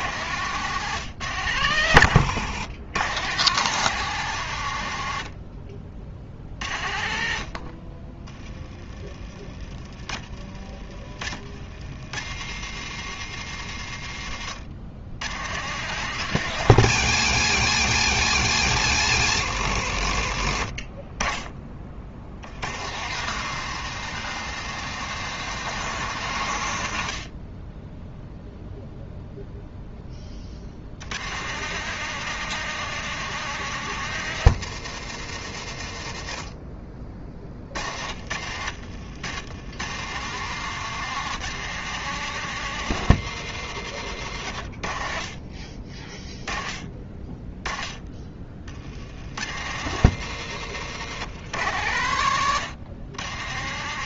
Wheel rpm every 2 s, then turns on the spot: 120, 110, 70, 60, 30, 50, 120, 110, 120, 90, 20, 120, 150, 50, 0, 100, 160, 120, 40, 90, 150, 130, 50, 20, 80, 110, 110.
none